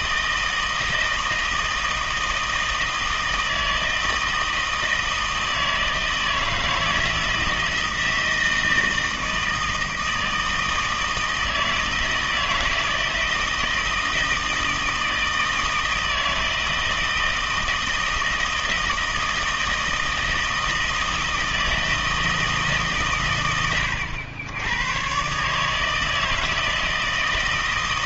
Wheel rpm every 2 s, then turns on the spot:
160, 160, 160, 160, 160, 160, 160, 160, 160, 160, 160, 160, 100, 160.
none